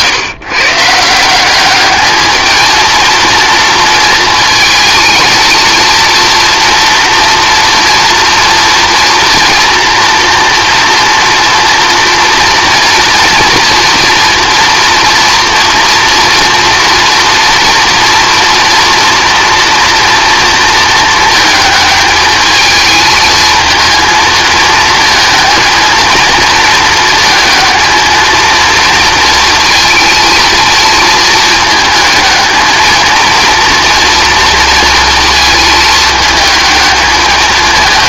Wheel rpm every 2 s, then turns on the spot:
140, 220, 230, 230, 240, 230, 230, 230, 230, 240, 230, 220, 230, 230, 230, 230, 220, 230, 220.
none